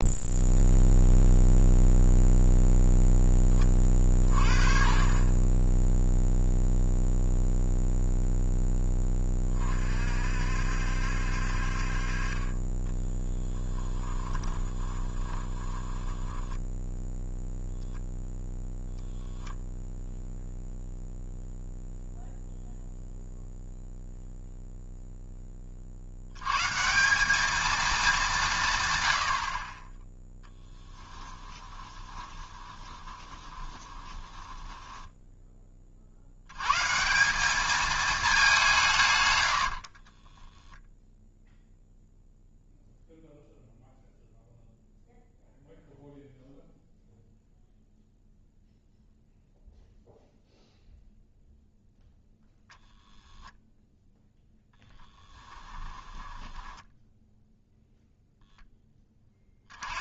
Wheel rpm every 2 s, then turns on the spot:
0, 0, 40, 0, 10, 60, 30, 20, 10, 0, 0, 0, 0, 150, 150, 10, 20, 10, 130, 180, 0, 0, 0, 0, 0, 0, 0, 10, 10, 10.
12-18 30-36 54-58